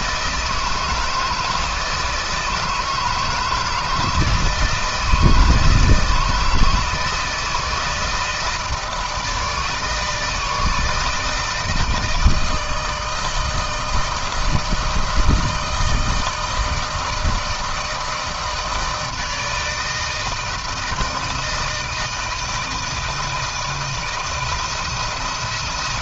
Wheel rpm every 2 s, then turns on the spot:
160, 160, 160, 160, 160, 160, 160, 160, 160, 160, 160, 160, 170.
none